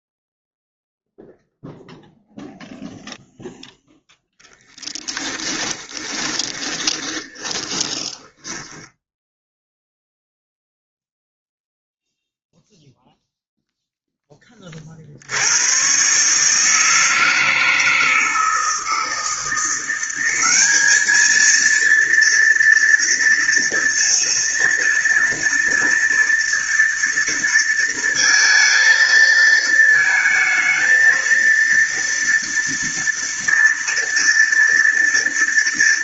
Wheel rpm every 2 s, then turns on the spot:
0, 0, 10, 20, 0, 0, 0, 60, 160, 160, 220, 230, 230, 230, 220, 230, 230, 230.
4-8